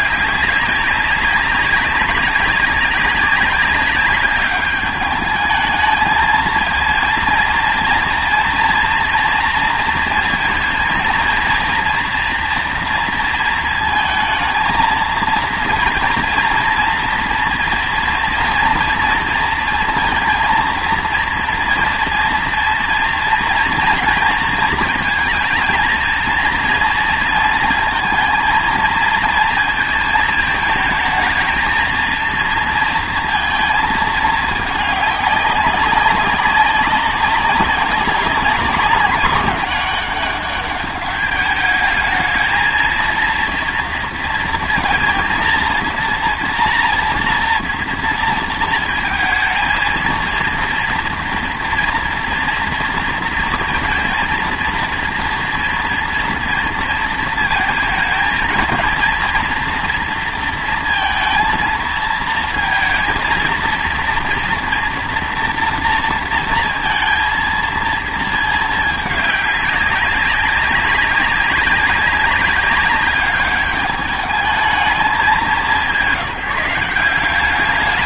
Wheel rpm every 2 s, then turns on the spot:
200, 200, 210, 230, 230, 230, 230, 220, 230, 230, 230, 230, 230, 230, 230, 220, 230, 210, 200, 200, 200, 220, 230, 230, 230, 230, 230, 230, 230, 220, 230, 230, 240, 230, 220, 200, 200, 210, 180.
none